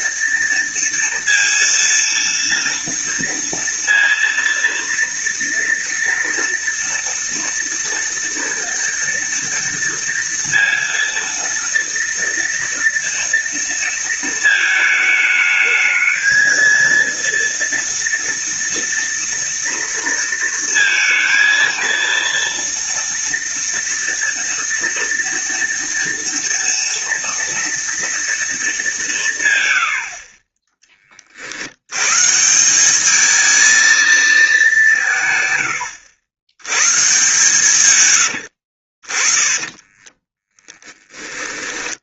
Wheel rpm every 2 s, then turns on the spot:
230, 230, 230, 230, 230, 230, 230, 220, 230, 230, 230, 230, 230, 230, 200, 20, 180, 180, 120, 60, 20.
38-40